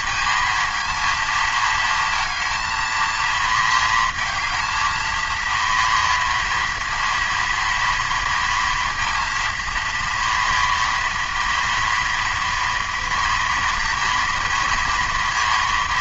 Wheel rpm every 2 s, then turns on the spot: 230, 230, 220, 230, 230, 230, 230, 230.
none